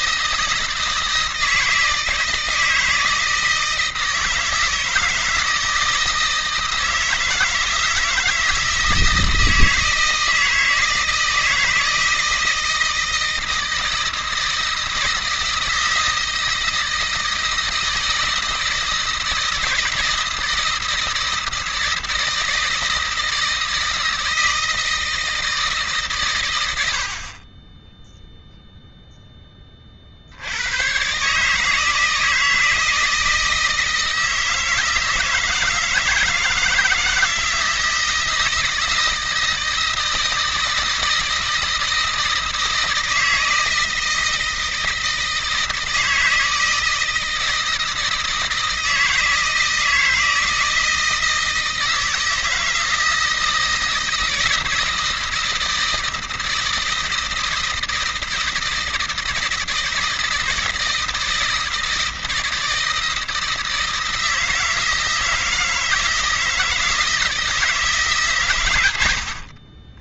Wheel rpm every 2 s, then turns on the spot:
160, 160, 160, 160, 160, 160, 160, 160, 160, 160, 160, 160, 160, 110, 0, 80, 160, 160, 160, 160, 160, 160, 160, 160, 160, 160, 160, 160, 160, 170, 160, 160, 160, 160, 120.
none